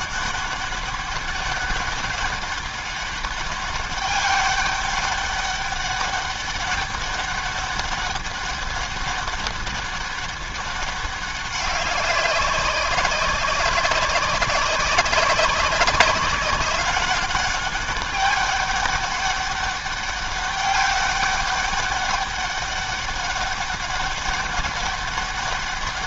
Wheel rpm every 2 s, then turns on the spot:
200, 200, 200, 200, 200, 200, 190, 190, 200, 200, 200, 200, 190.
none